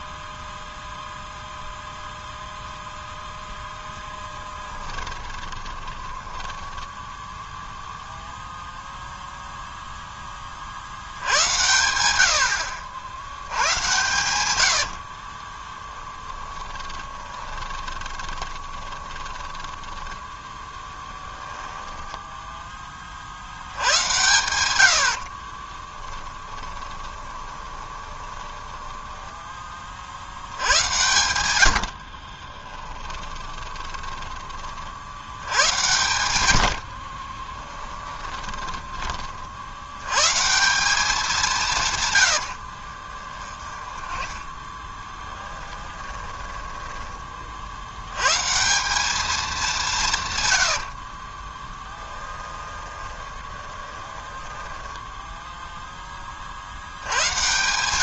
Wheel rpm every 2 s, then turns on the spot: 0, 0, 10, 10, 0, 50, 70, 80, 20, 20, 10, 20, 100, 10, 10, 90, 20, 50, 70, 20, 180, 60, 10, 10, 160, 60, 10, 10, 60.
4-8 16-20 26-30 32-34 36-40 42-48 50-56